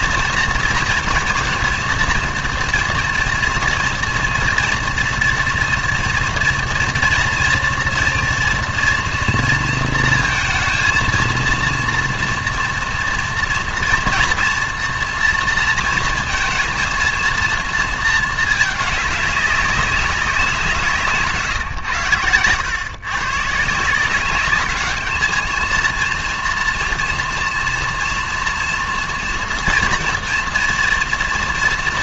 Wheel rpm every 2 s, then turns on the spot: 230, 230, 230, 230, 230, 230, 230, 230, 220, 210, 180, 120, 200, 230, 230, 240.
none